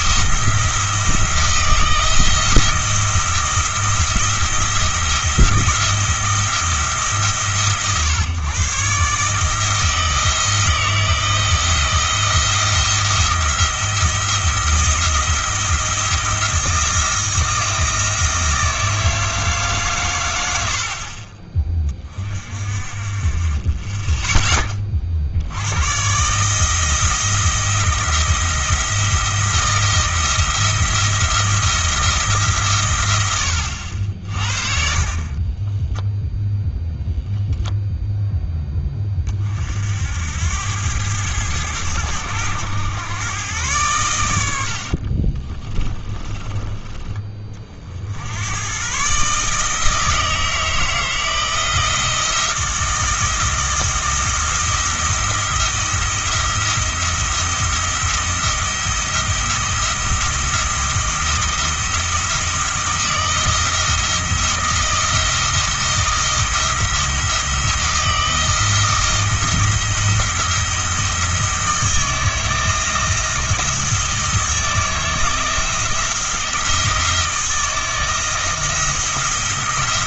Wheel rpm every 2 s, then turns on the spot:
160, 170, 170, 160, 130, 160, 170, 170, 160, 160, 70, 40, 20, 160, 170, 170, 140, 50, 0, 10, 90, 100, 70, 20, 110, 160, 170, 170, 170, 170, 170, 170, 170, 170, 170, 170, 160, 160, 170, 170.
44-46